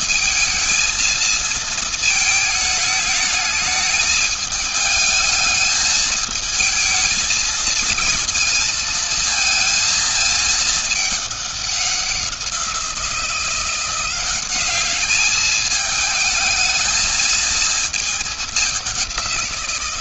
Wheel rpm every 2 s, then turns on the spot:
230, 220, 210, 220, 230, 220, 180, 190, 220, 210.
none